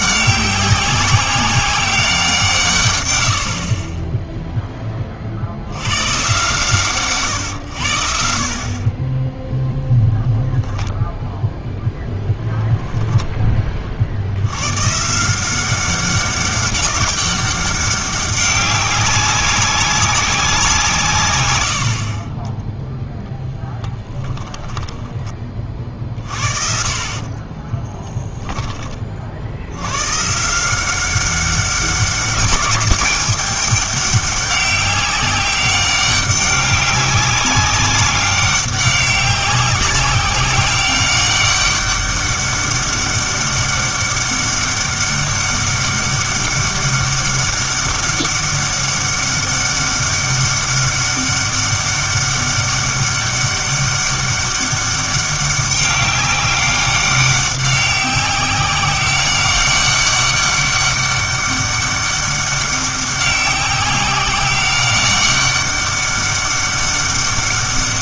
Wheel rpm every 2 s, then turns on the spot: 190, 140, 10, 140, 40, 0, 10, 120, 200, 200, 170, 20, 10, 50, 20, 170, 190, 200, 200, 190, 190, 200, 200, 200, 200, 200, 200, 200, 200, 190, 200, 200, 200, 200.
22-26